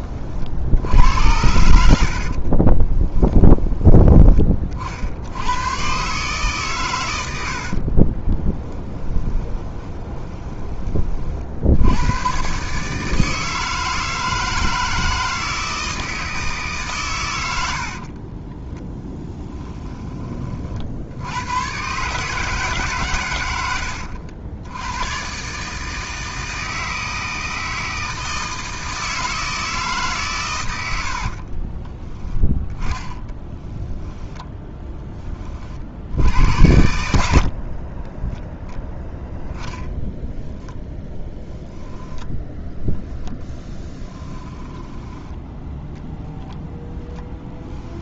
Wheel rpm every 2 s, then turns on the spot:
70, 40, 50, 130, 20, 20, 140, 160, 140, 10, 60, 150, 100, 160, 160, 90, 10, 10, 80, 0, 0, 0, 10, 10.
2-4 8-10 18-20 32-34 44-46